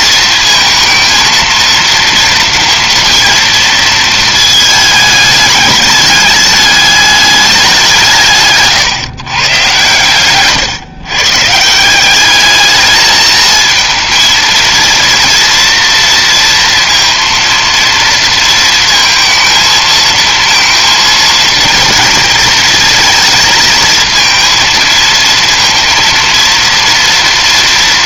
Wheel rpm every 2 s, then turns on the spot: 230, 230, 220, 210, 130, 130, 210, 230, 230, 230, 230, 230, 230, 230.
8-10